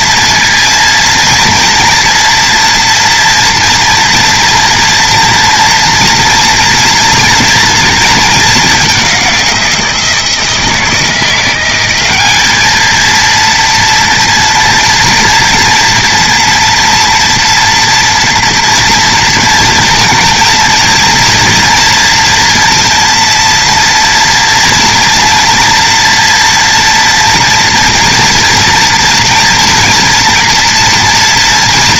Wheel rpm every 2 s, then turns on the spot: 230, 230, 240, 230, 210, 160, 220, 230, 230, 230, 230, 230, 230, 230, 230, 230.
none